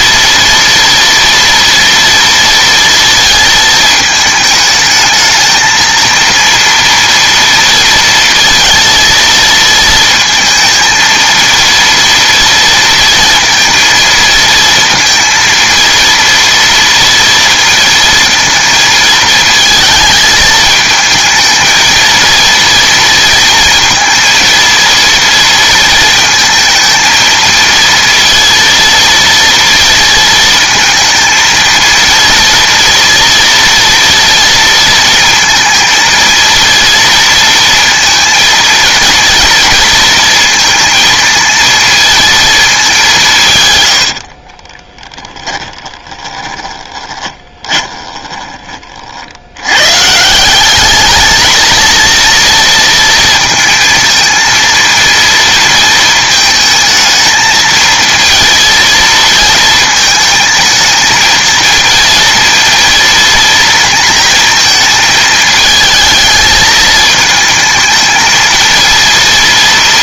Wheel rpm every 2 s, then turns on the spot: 230, 230, 220, 230, 230, 230, 230, 230, 230, 220, 220, 230, 230, 220, 230, 230, 230, 230, 230, 230, 230, 210, 20, 20, 40, 190, 230, 230, 220, 230, 220, 230, 220, 220, 230.
44-48